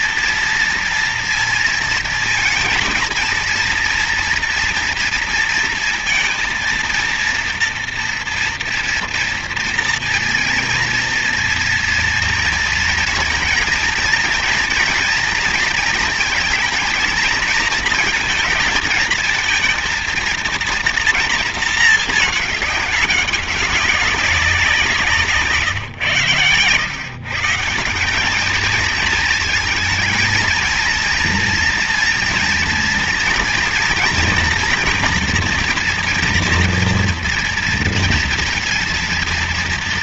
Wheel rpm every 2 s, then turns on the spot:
230, 230, 230, 230, 230, 230, 230, 230, 230, 220, 230, 200, 180, 120, 210, 220, 230, 240, 230, 230.
none